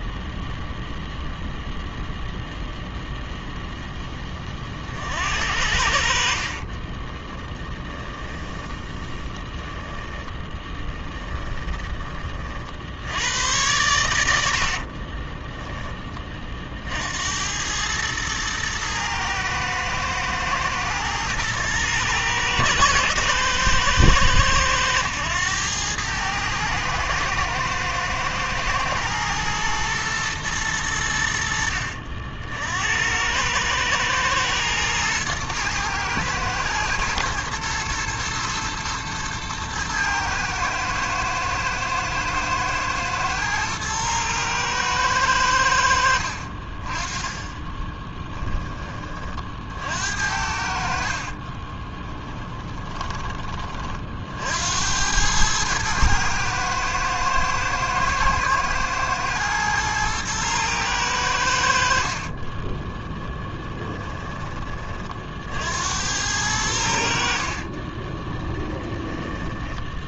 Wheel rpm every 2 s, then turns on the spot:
0, 0, 40, 30, 10, 20, 60, 60, 50, 110, 110, 110, 110, 110, 110, 110, 70, 110, 120, 110, 110, 110, 110, 30, 20, 60, 10, 70, 110, 110, 110, 20, 20, 80, 20.
6-8 10-12 14-16 52-54 62-64 68-70